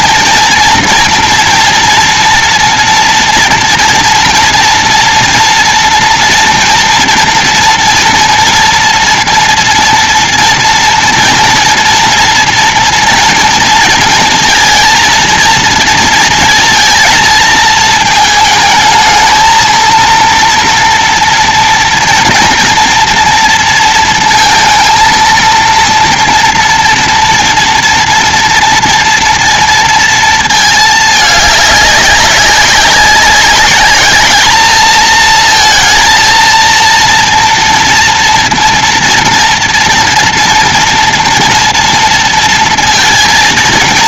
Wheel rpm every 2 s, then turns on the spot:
230, 240, 240, 230, 230, 230, 230, 230, 230, 220, 230, 230, 230, 230, 240, 230, 200, 220, 230, 230, 230, 230.
none